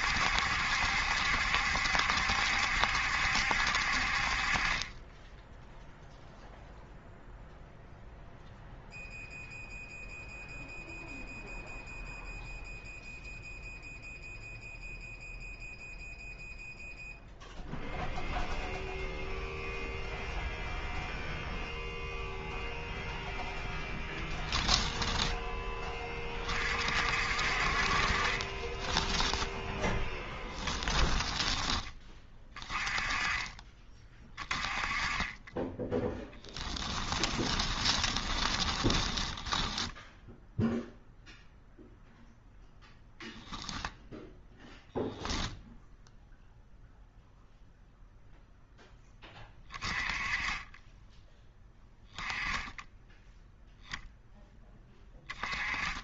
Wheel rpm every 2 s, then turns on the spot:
70, 70, 30, 0, 0, 0, 0, 0, 0, 0, 0, 0, 10, 40, 20, 10, 20, 20, 20, 20, 0, 0, 0, 0, 10, 20, 10, 10.
24-26 28-32 36-40